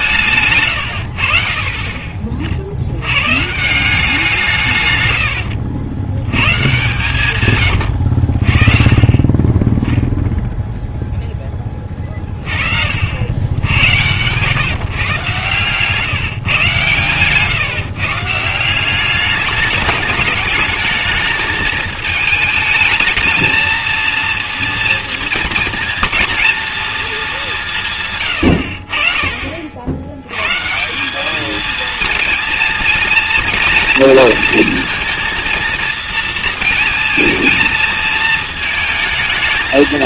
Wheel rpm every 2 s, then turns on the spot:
140, 70, 150, 120, 30, 0, 40, 140, 140, 180, 210, 220, 230, 230, 90, 140, 230, 230, 230, 220.
none